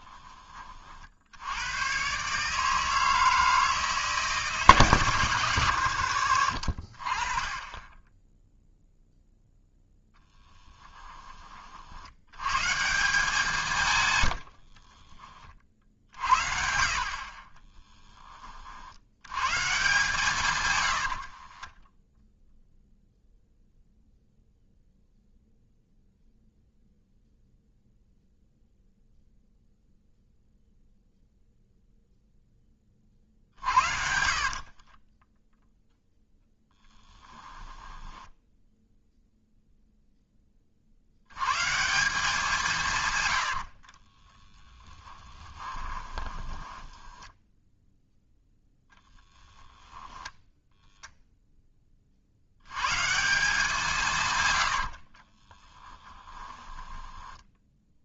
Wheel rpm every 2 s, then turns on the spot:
30, 160, 160, 50, 0, 10, 150, 40, 90, 40, 110, 0, 0, 0, 0, 0, 20, 40, 10, 0, 30, 160, 10, 20, 20, 0, 110, 90, 10.
6-8 10-12 14-16 34-38 44-50 54-58